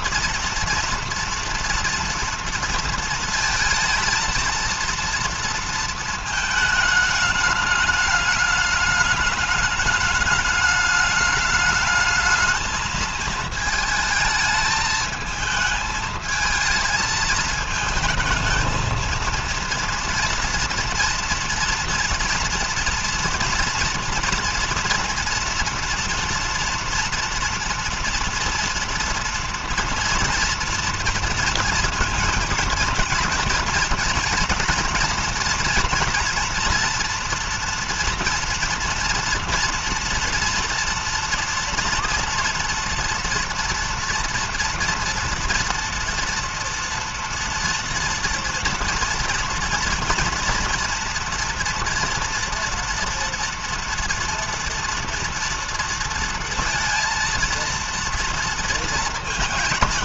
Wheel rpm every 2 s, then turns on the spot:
230, 230, 230, 220, 210, 210, 220, 220, 220, 220, 240, 230, 230, 230, 230, 230, 230, 230, 230, 230, 230, 230, 230, 230, 230, 230, 230, 230, 230, 230.
none